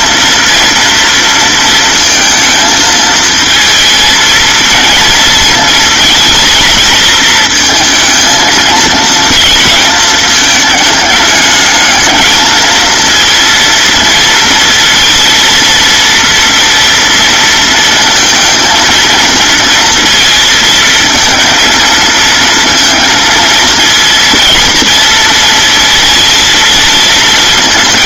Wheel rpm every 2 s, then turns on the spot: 230, 220, 230, 220, 230, 210, 230, 230, 230, 230, 230, 230, 230, 220.
none